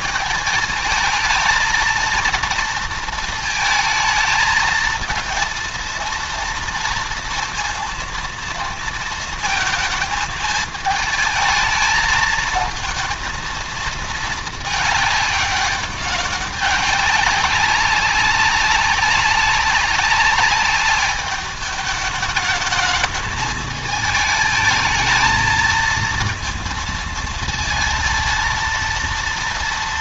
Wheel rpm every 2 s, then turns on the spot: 220, 230, 220, 230, 230, 220, 220, 220, 200, 200, 200, 210, 220, 230, 230.
none